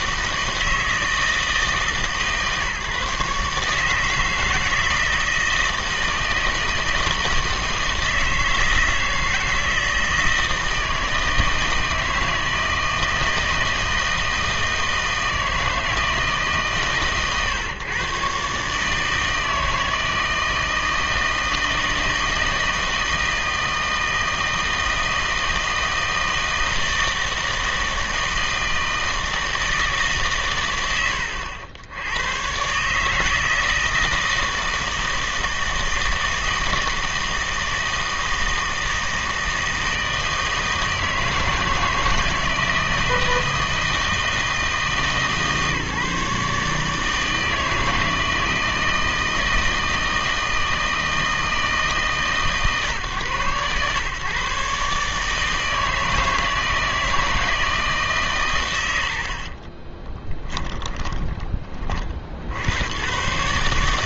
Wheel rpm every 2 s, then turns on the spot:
160, 150, 160, 160, 160, 160, 160, 160, 140, 150, 160, 160, 160, 160, 160, 90, 150, 160, 160, 160, 160, 160, 150, 150, 160, 160, 130, 140, 160, 110, 10, 100.
60-62